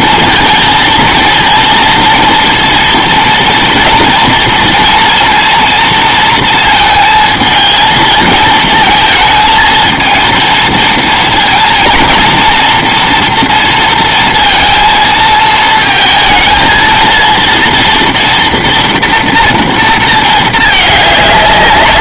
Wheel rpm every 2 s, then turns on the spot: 230, 230, 230, 220, 230, 230, 230, 230, 220, 230, 210.
none